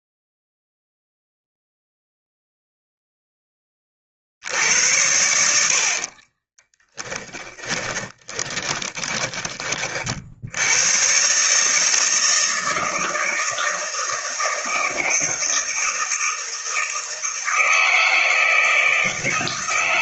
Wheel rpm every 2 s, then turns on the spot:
0, 0, 80, 30, 20, 90, 160, 160, 160, 160.
6-10